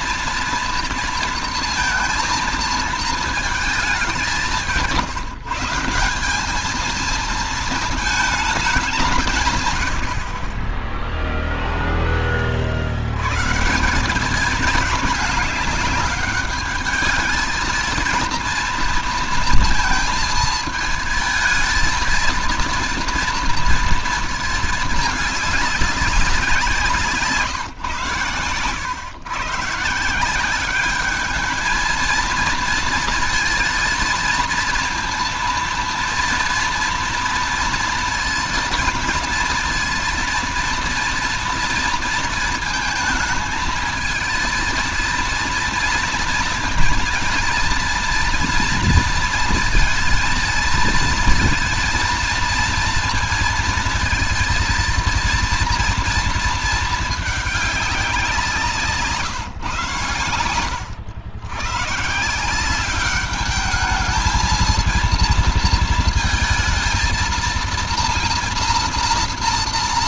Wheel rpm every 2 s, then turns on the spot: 230, 230, 170, 220, 190, 20, 60, 200, 210, 230, 220, 230, 220, 180, 110, 200, 230, 230, 230, 230, 230, 220, 230, 230, 230, 230, 230, 230, 220, 160, 90, 190, 230, 230, 230.
none